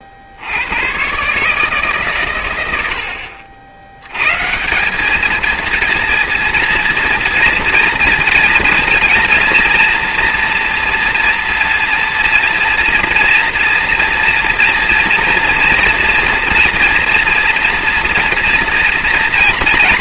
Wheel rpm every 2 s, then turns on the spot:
130, 70, 200, 230, 230, 240, 230, 240, 230, 230.
none